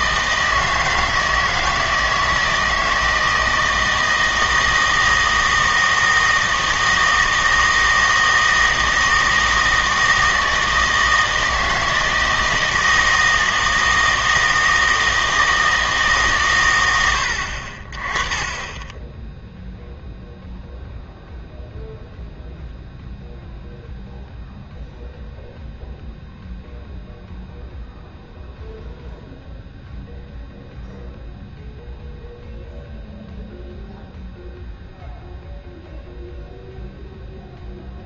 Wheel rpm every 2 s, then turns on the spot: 160, 160, 160, 160, 160, 160, 160, 160, 130, 20, 0, 0, 0, 0, 0, 0, 0, 0, 0.
none